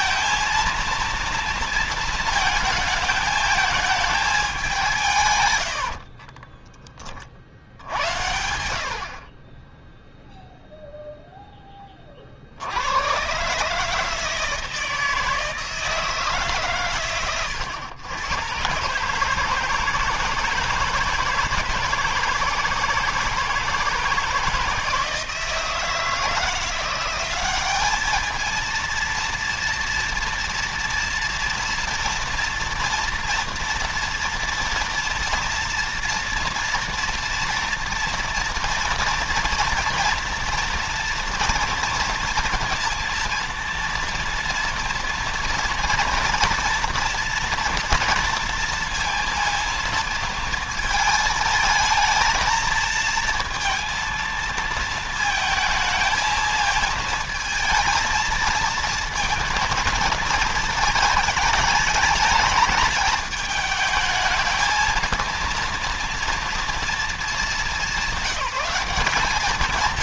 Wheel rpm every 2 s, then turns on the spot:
220, 220, 210, 30, 80, 0, 70, 160, 140, 120, 160, 160, 160, 170, 220, 230, 230, 230, 230, 240, 240, 230, 230, 230, 230, 220, 220, 230, 220, 230, 220, 220, 220, 230, 190.
6-10